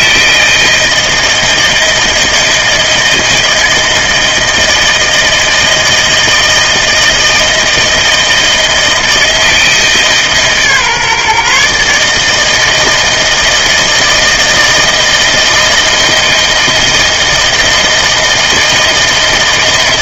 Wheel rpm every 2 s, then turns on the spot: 160, 160, 160, 160, 160, 150, 160, 160, 160, 160.
none